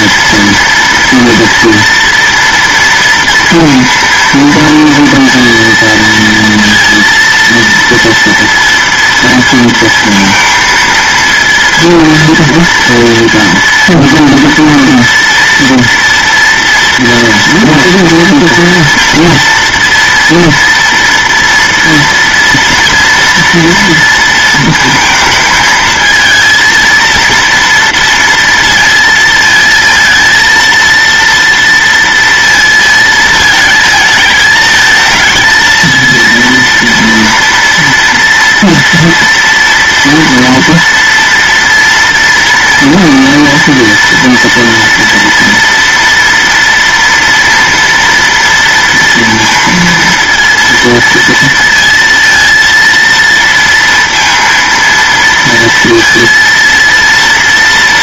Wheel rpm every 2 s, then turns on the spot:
230, 230, 230, 230, 230, 230, 230, 230, 240, 230, 230, 230, 230, 230, 230, 230, 230, 220, 230, 230, 230, 240, 240, 240, 230, 230, 230, 230, 230.
none